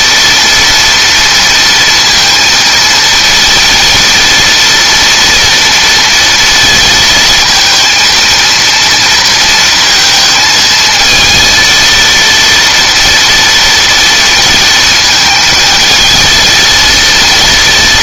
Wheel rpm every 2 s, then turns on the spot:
230, 230, 230, 220, 230, 220, 230, 230, 230.
none